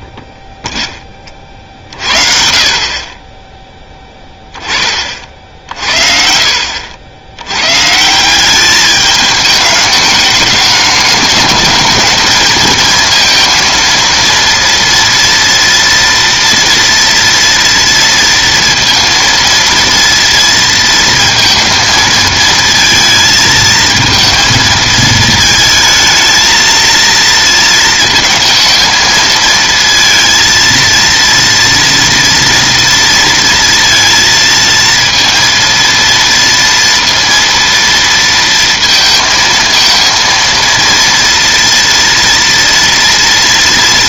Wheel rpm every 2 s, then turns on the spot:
0, 50, 10, 60, 200, 210, 220, 230, 230, 230, 230, 220, 220, 230, 230, 230, 230, 230, 230, 230, 230, 230.
none